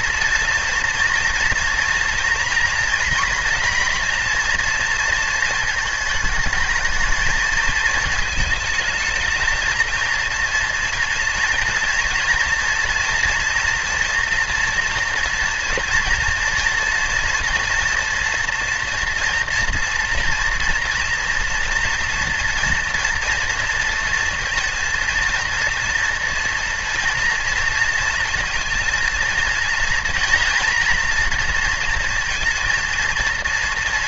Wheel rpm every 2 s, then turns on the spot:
230, 230, 230, 220, 220, 240, 230, 230, 230, 240, 230, 230, 230, 240, 230, 240, 230.
none